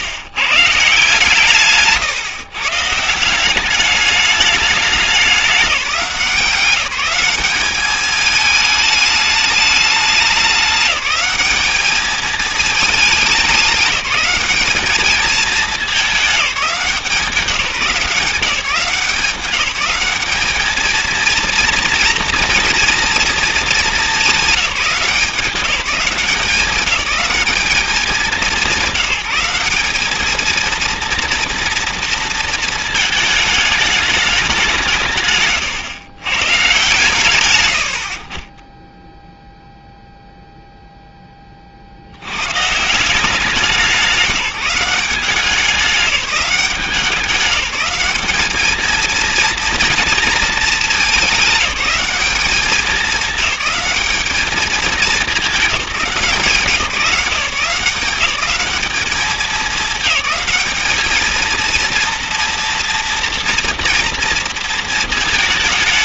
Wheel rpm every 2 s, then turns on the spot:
140, 140, 210, 190, 210, 200, 220, 210, 200, 180, 220, 230, 200, 190, 190, 230, 220, 180, 130, 10, 0, 130, 180, 190, 220, 220, 210, 220, 190, 210, 210, 230, 230.
none